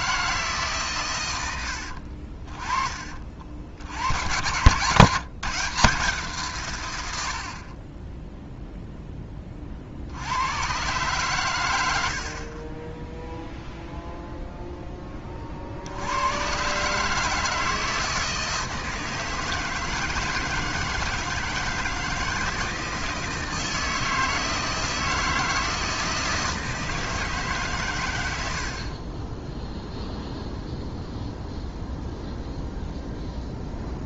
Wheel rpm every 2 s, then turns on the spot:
130, 30, 140, 120, 0, 120, 10, 10, 150, 160, 160, 160, 160, 160, 40, 0, 0.
12-14